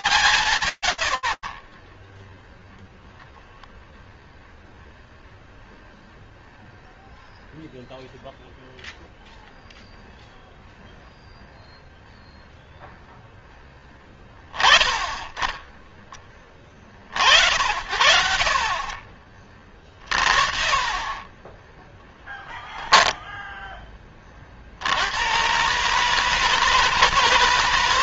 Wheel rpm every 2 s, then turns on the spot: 20, 0, 0, 0, 0, 0, 10, 20, 50, 60, 10, 20, 150, 90.
none